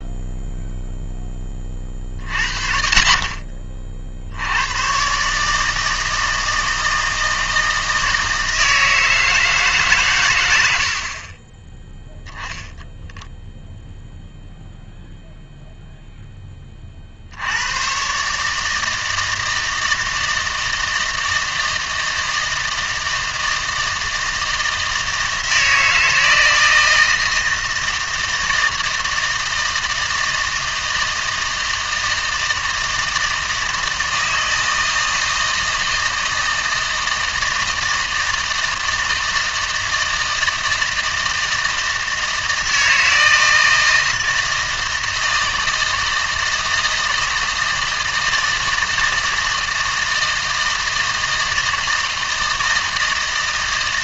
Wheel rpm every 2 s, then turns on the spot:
0, 50, 120, 160, 160, 70, 0, 0, 40, 160, 160, 170, 160, 160, 160, 160, 160, 160, 160, 160, 160, 160, 160, 160, 160, 160, 160.
none